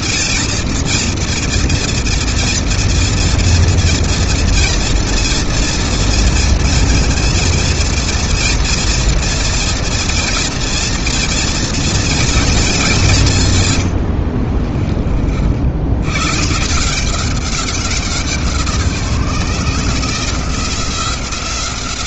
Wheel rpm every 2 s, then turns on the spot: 230, 240, 230, 220, 230, 230, 190, 50, 180, 160, 180.
none